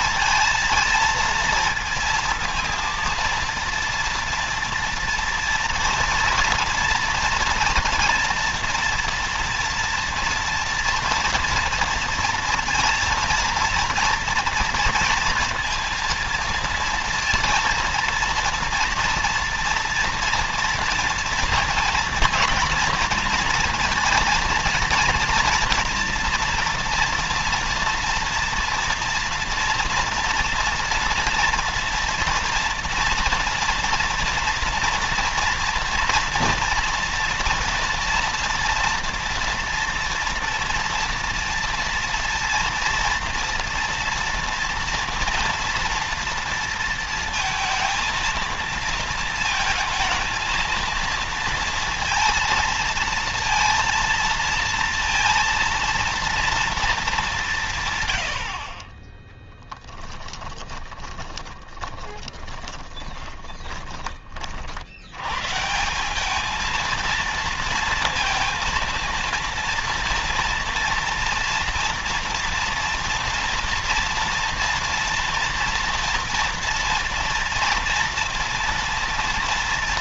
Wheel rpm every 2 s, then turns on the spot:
230, 230, 230, 230, 240, 230, 230, 230, 230, 230, 230, 230, 230, 240, 230, 230, 230, 240, 230, 230, 230, 230, 230, 230, 220, 230, 230, 230, 230, 130, 20, 20, 30, 200, 230, 240, 230, 230, 230, 230.
60-64